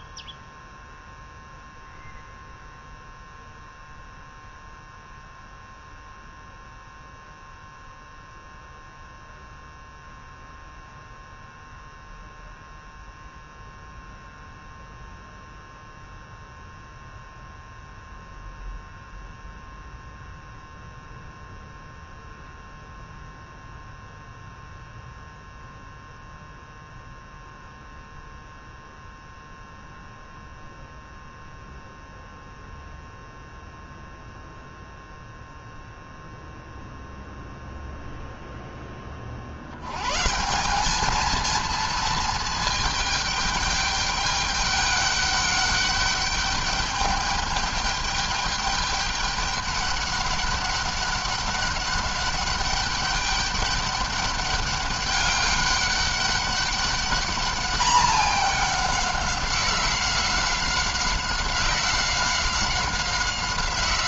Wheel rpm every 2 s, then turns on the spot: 0, 0, 0, 0, 0, 0, 0, 0, 0, 0, 0, 0, 0, 0, 0, 0, 0, 0, 0, 20, 200, 220, 200, 210, 210, 200, 200, 200, 200, 200, 190, 190.
none